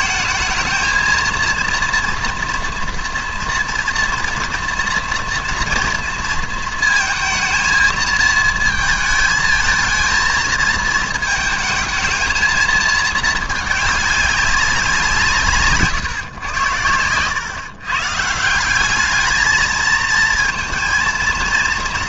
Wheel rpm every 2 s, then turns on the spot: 220, 230, 230, 230, 220, 220, 220, 190, 100, 190, 230.
none